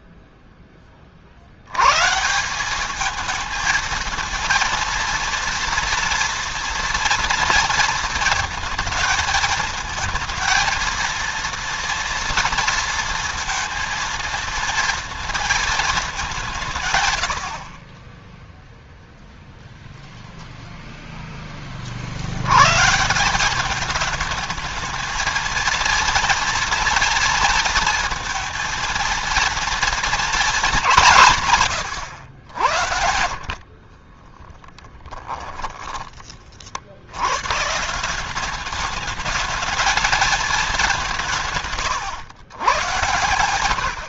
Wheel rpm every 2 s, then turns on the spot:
30, 200, 230, 230, 220, 230, 230, 230, 140, 0, 0, 140, 220, 230, 230, 200, 70, 10, 80, 210, 210, 110.
34-36